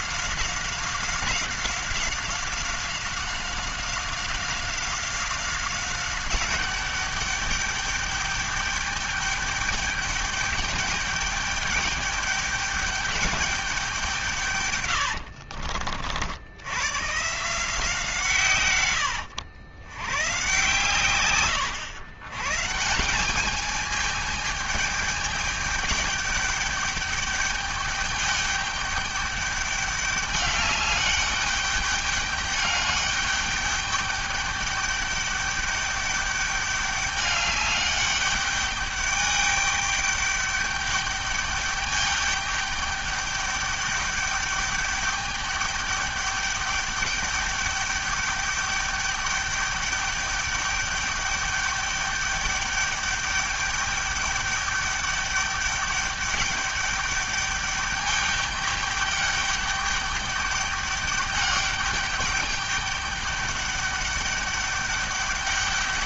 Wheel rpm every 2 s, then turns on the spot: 190, 190, 190, 190, 200, 210, 210, 170, 70, 140, 110, 130, 210, 200, 200, 200, 210, 210, 200, 200, 210, 210, 210, 210, 200, 210, 210, 200, 210, 200, 200, 200, 200.
none